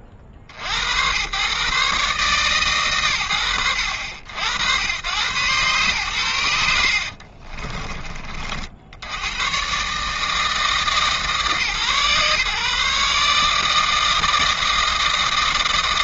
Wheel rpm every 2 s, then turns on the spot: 40, 130, 80, 80, 50, 160, 140, 160.
6-8